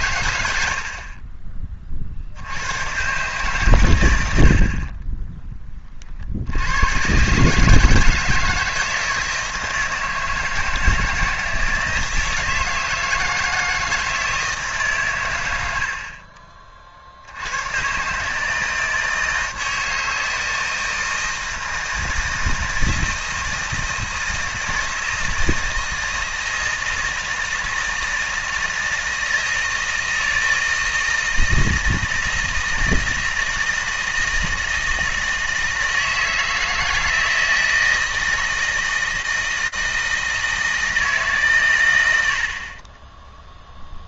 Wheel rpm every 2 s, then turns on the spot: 40, 130, 30, 110, 160, 160, 160, 140, 50, 160, 160, 160, 160, 160, 160, 160, 160, 160, 160, 160, 160, 20.
none